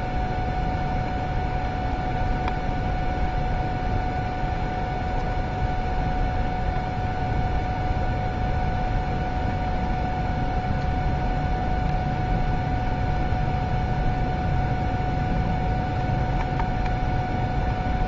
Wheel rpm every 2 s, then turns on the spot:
0, 0, 0, 0, 0, 0, 0, 0, 0.
none